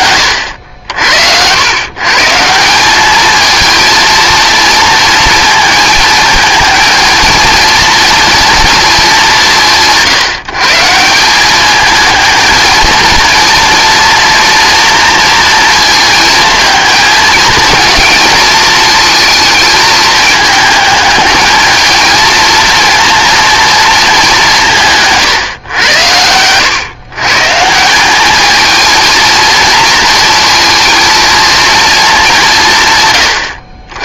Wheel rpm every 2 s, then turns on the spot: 80, 180, 230, 220, 230, 160, 230, 230, 220, 220, 220, 230, 180, 100, 220, 230, 160.
none